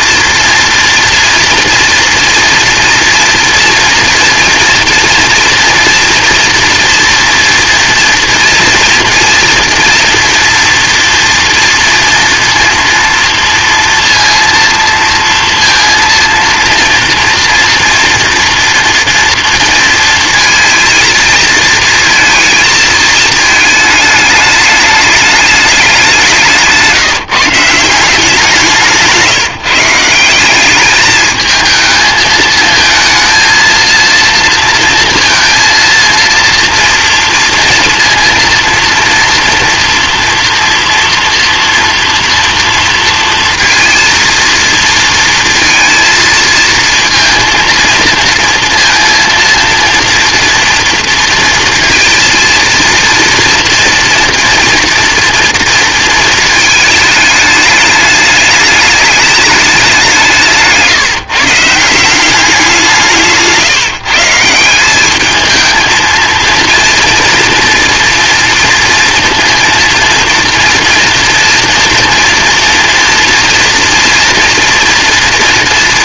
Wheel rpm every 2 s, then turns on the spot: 230, 230, 240, 230, 230, 230, 230, 230, 230, 230, 230, 230, 210, 170, 180, 190, 220, 230, 230, 230, 230, 230, 230, 230, 230, 230, 230, 230, 220, 210, 170, 190, 170, 230, 230, 230, 240, 230.
none